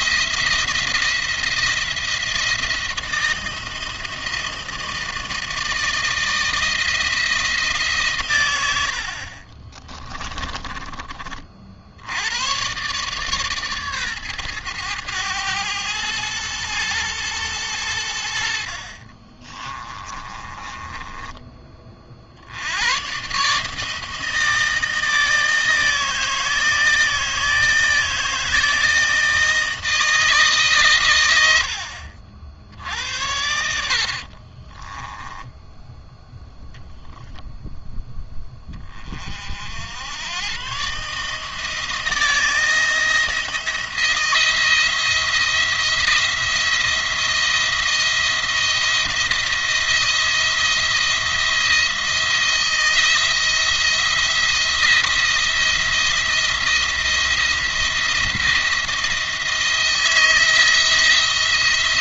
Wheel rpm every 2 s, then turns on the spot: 170, 160, 160, 160, 90, 30, 120, 110, 110, 50, 20, 110, 160, 160, 160, 130, 70, 40, 0, 20, 130, 170, 170, 170, 170, 170, 170, 170, 170, 170, 170.
8-12 18-22 34-36